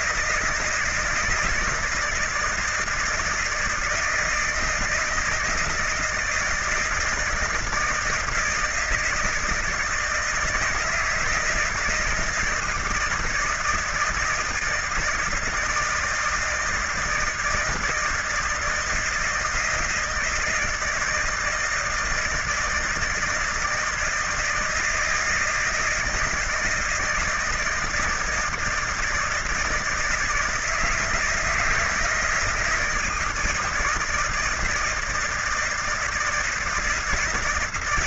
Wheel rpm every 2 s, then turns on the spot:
160, 170, 160, 160, 160, 160, 160, 160, 160, 160, 160, 160, 160, 160, 160, 160, 160, 160, 160.
none